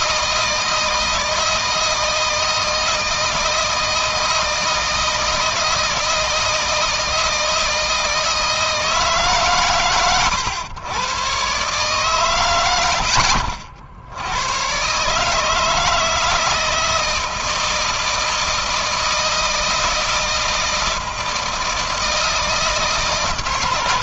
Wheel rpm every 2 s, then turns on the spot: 160, 160, 160, 160, 160, 100, 100, 110, 160, 160, 160, 160.
none